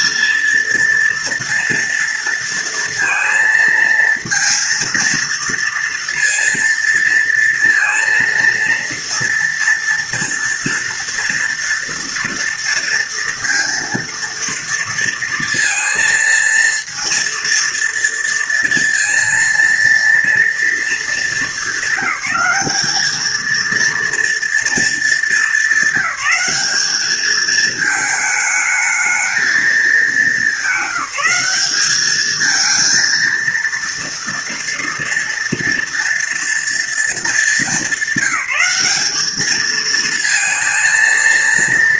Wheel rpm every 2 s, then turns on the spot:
230, 230, 230, 230, 230, 230, 240, 230, 230, 230, 230, 210, 230, 200, 220, 210, 220, 230, 230, 190, 230.
none